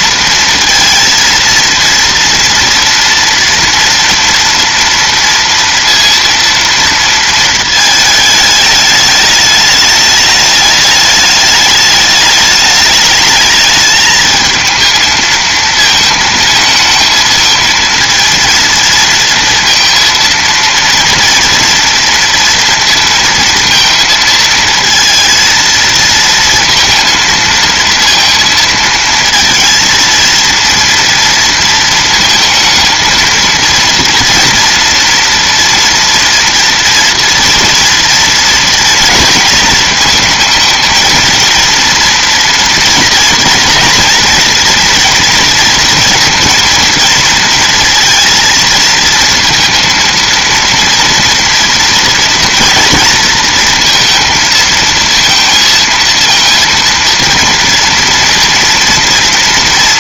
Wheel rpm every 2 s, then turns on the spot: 230, 230, 230, 230, 210, 210, 210, 220, 220, 230, 230, 230, 230, 230, 230, 230, 220, 230, 230, 230, 230, 220, 230, 230, 230, 230, 230, 220, 230, 230.
none